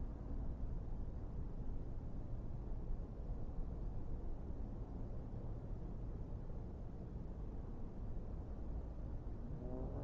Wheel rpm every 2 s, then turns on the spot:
0, 0, 0, 0, 0.
none